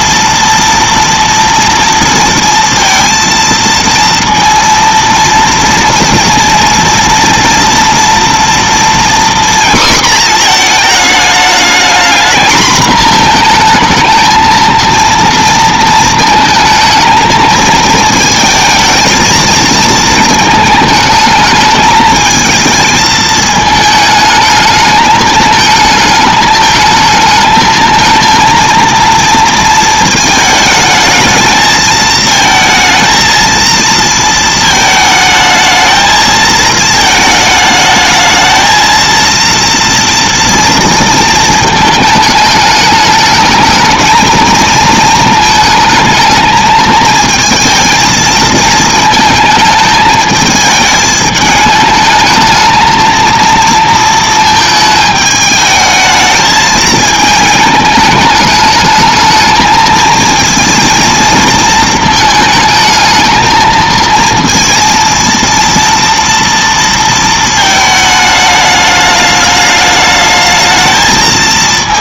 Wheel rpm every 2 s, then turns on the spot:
230, 230, 230, 230, 240, 230, 230, 230, 220, 220, 220, 220, 210, 220, 230, 220, 220, 220, 220, 220, 230, 210, 220, 220, 230, 220, 220, 220, 220, 220, 230, 220, 230, 230, 210, 220.
none